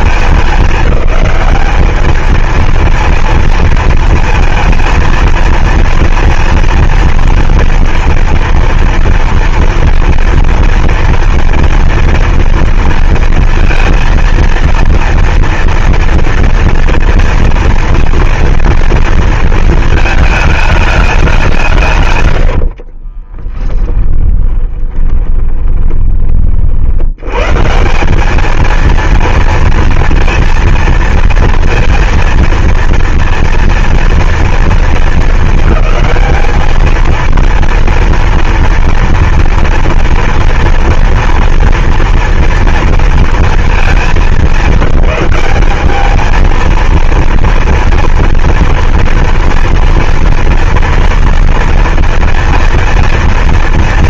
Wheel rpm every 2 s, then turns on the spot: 210, 230, 220, 230, 230, 230, 240, 230, 230, 230, 200, 40, 20, 70, 230, 230, 230, 230, 220, 230, 230, 230, 210, 230, 230, 230, 230.
22-26